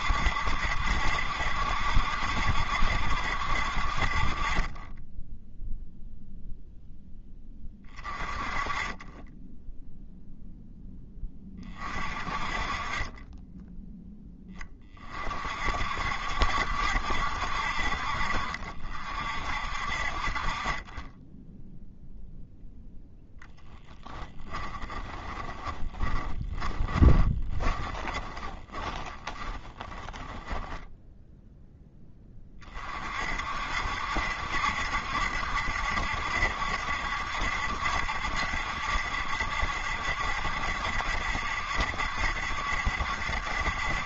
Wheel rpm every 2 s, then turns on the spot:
70, 70, 0, 10, 30, 0, 40, 20, 60, 60, 30, 0, 20, 20, 20, 10, 30, 70, 70, 70, 70, 70.
24-30